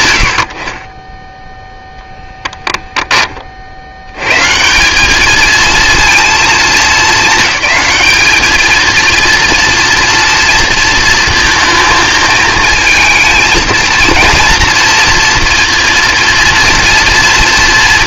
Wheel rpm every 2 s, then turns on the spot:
80, 10, 180, 210, 220, 230, 230, 230, 230.
none